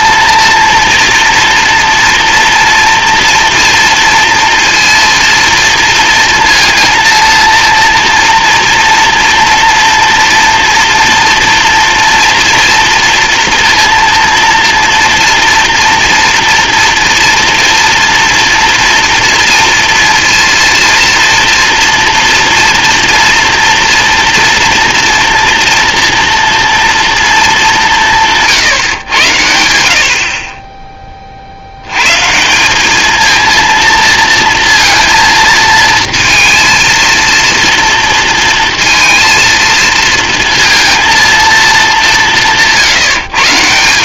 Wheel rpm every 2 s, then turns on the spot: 230, 230, 230, 230, 230, 240, 230, 230, 230, 230, 230, 230, 230, 230, 140, 20, 190, 230, 230, 230, 230, 160.
none